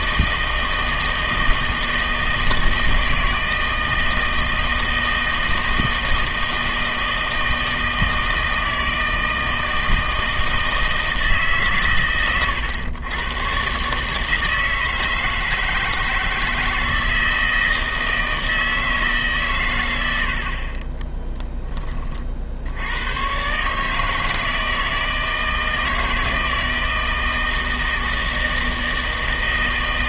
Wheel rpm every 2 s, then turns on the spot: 160, 160, 160, 160, 160, 160, 110, 160, 160, 160, 30, 80, 160, 160, 160.
none